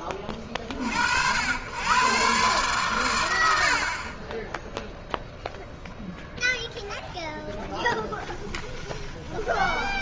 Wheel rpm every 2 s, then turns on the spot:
60, 100, 0, 20, 20.
6-10